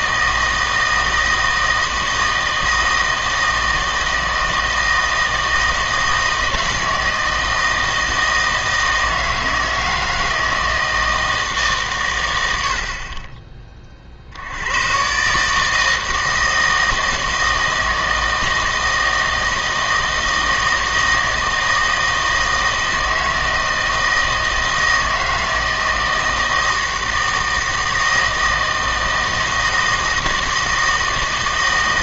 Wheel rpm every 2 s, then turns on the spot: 160, 160, 160, 160, 160, 160, 70, 100, 160, 160, 160, 160, 160, 160, 160, 160.
none